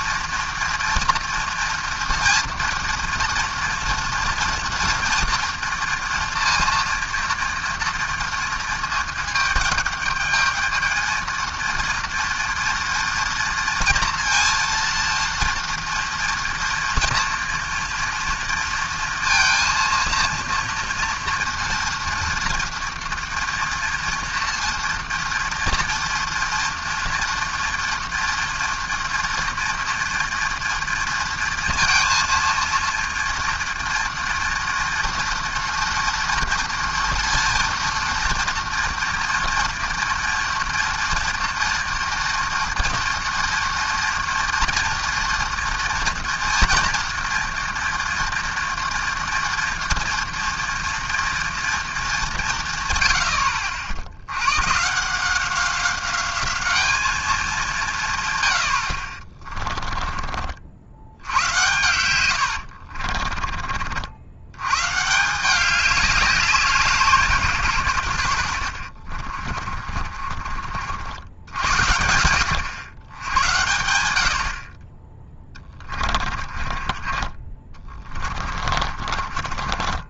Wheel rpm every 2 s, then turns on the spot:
230, 230, 240, 230, 220, 220, 240, 230, 230, 230, 230, 230, 230, 230, 230, 230, 230, 230, 230, 230, 230, 230, 230, 230, 230, 240, 110, 160, 210, 60, 60, 60, 130, 180, 60, 60, 110, 40, 30, 40.
62-64 68-70 76-80